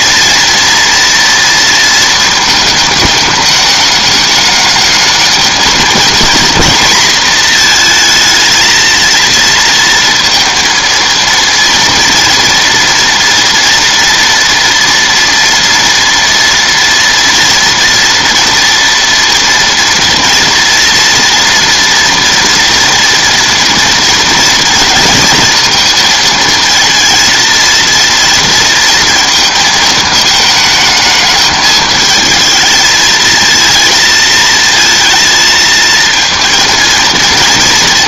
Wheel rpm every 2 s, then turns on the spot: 230, 220, 210, 230, 230, 230, 230, 240, 230, 230, 230, 230, 230, 230, 230, 220, 220, 220, 230.
none